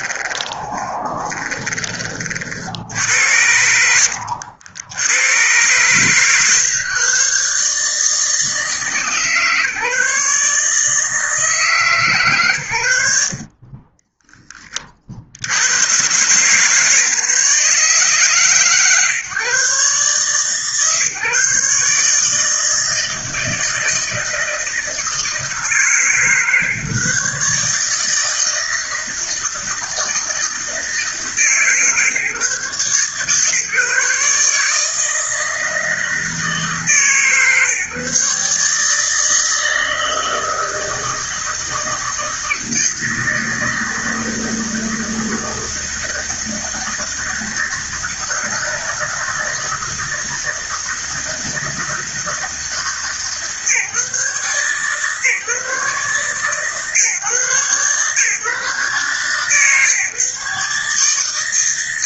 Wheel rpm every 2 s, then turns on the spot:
20, 70, 90, 130, 160, 160, 80, 40, 150, 130, 140, 160, 160, 140, 160, 160, 140, 160, 150, 160, 160, 160, 160, 160, 160, 160, 160, 140, 140, 140, 150.
0-2 12-14